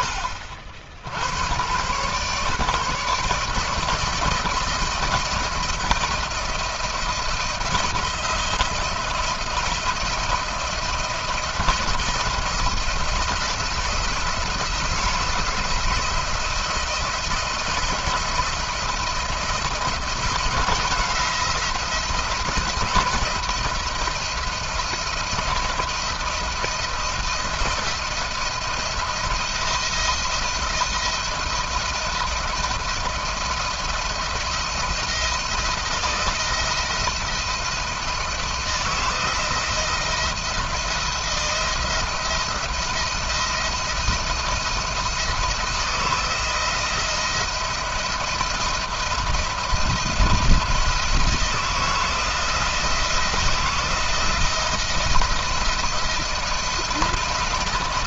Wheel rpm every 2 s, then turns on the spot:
70, 150, 170, 160, 170, 170, 170, 170, 170, 170, 170, 170, 170, 170, 170, 170, 170, 170, 170, 170, 170, 170, 170, 170, 170, 170, 160, 170, 170.
none